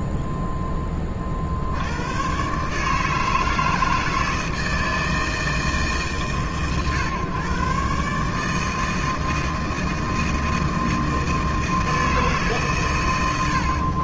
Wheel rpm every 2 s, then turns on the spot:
0, 70, 160, 150, 130, 160, 160.
none